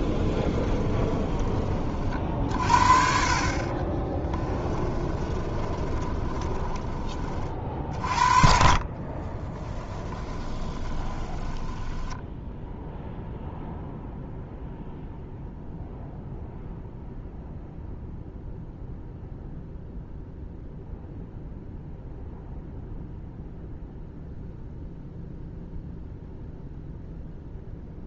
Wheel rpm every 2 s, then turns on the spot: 20, 50, 20, 20, 40, 20, 0, 0, 0, 0, 0, 0, 0, 0.
0-2 4-12